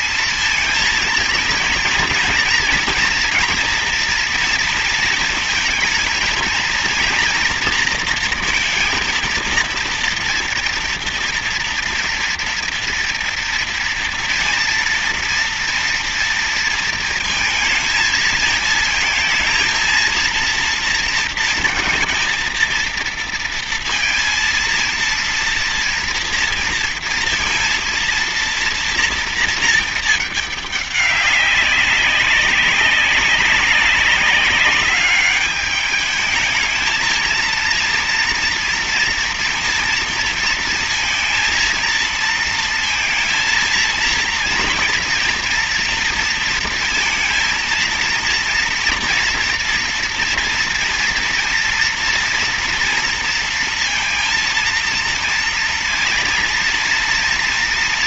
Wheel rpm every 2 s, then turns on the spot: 230, 230, 230, 230, 230, 230, 230, 230, 230, 220, 230, 230, 230, 230, 230, 210, 190, 200, 220, 230, 230, 230, 230, 230, 230, 230, 230, 230, 230.
none